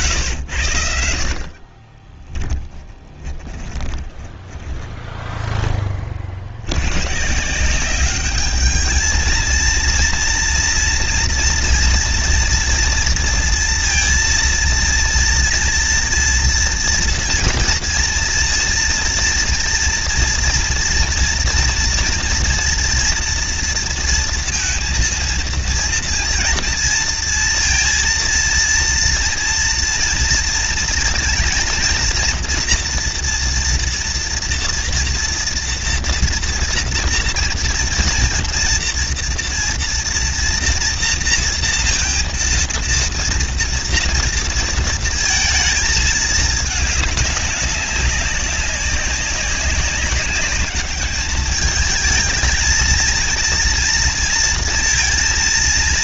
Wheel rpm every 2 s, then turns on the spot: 80, 10, 10, 80, 210, 230, 230, 230, 240, 230, 230, 240, 230, 230, 230, 230, 230, 230, 230, 230, 230, 230, 230, 210, 190, 200, 220, 230.
2-6